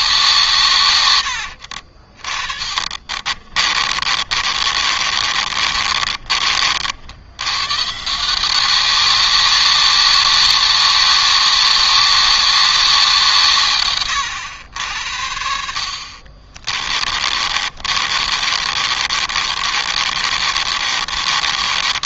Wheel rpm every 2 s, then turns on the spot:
120, 40, 40, 70, 190, 200, 180, 70, 30, 40, 40.
0-6 16-22